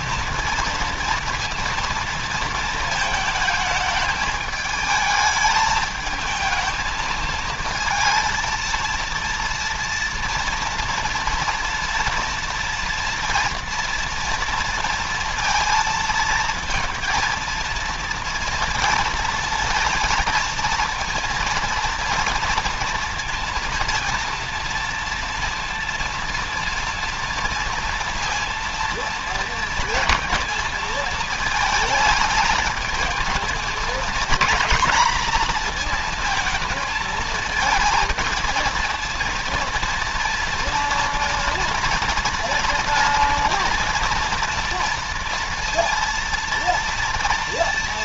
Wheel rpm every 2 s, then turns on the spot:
230, 230, 220, 220, 230, 230, 230, 230, 230, 230, 230, 230, 230, 230, 230, 230, 220, 230, 220, 230, 230, 240, 240, 230.
none